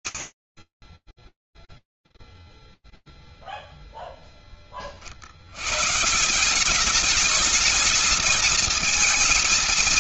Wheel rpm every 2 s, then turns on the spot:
30, 0, 20, 180, 220.
none